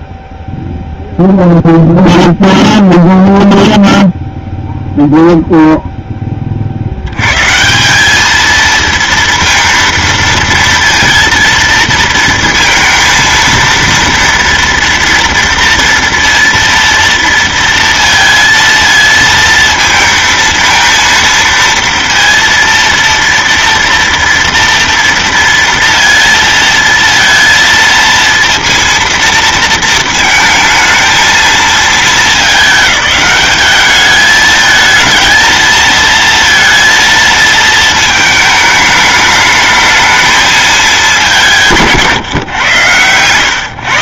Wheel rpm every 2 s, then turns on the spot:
0, 0, 0, 30, 220, 230, 230, 230, 230, 230, 230, 230, 230, 230, 230, 220, 210, 220, 230, 220, 220, 130.
none